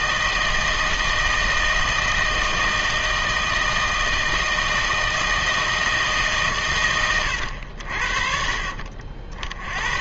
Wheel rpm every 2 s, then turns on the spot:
160, 160, 160, 120, 50.
none